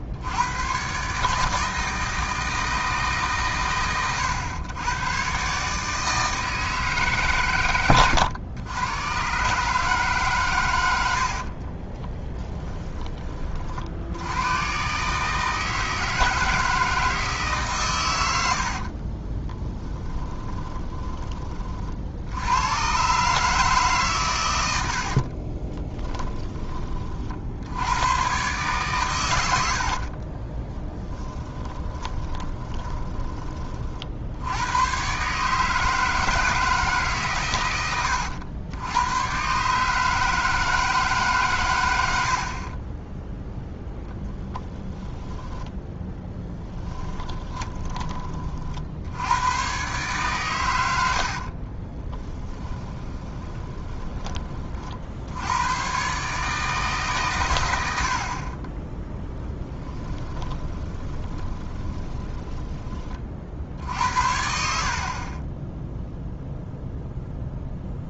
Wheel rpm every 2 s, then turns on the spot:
120, 160, 110, 160, 110, 110, 20, 130, 160, 60, 20, 110, 80, 30, 130, 20, 20, 100, 160, 90, 160, 30, 10, 10, 50, 100, 20, 40, 150, 30, 20, 20, 70, 0.
12-14 18-22 24-26 30-34 42-48 52-54 60-62